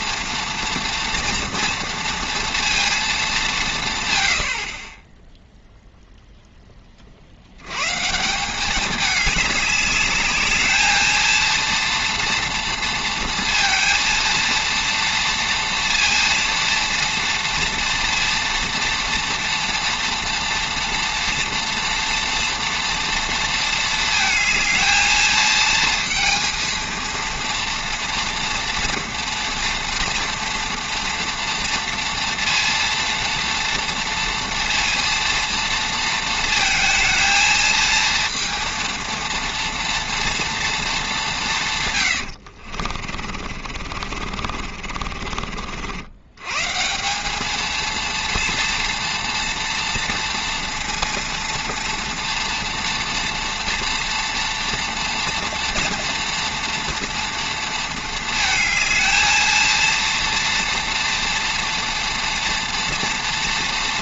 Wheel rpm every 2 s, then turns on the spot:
230, 210, 10, 40, 200, 220, 230, 230, 230, 230, 230, 230, 220, 230, 230, 230, 230, 230, 220, 230, 200, 40, 40, 190, 230, 230, 230, 230, 230, 220, 240, 230.
42-46